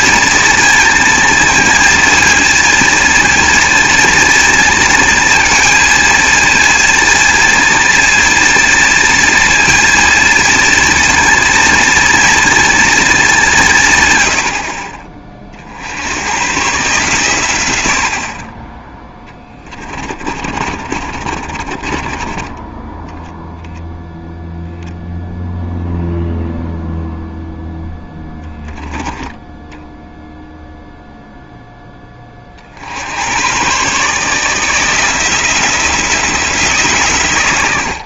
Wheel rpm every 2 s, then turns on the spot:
230, 230, 230, 230, 230, 230, 230, 60, 130, 30, 50, 10, 0, 0, 10, 0, 50, 160, 160.
18-22 28-30